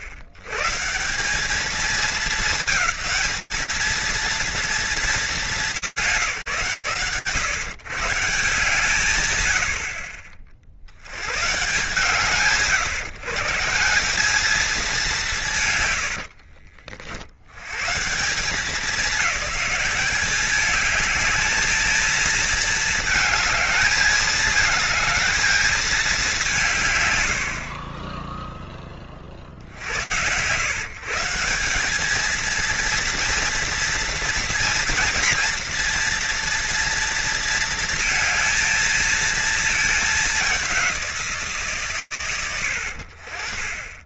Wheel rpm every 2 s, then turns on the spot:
100, 220, 230, 160, 140, 50, 140, 200, 80, 190, 200, 220, 220, 190, 10, 130, 230, 230, 230, 220, 200, 90.
16-18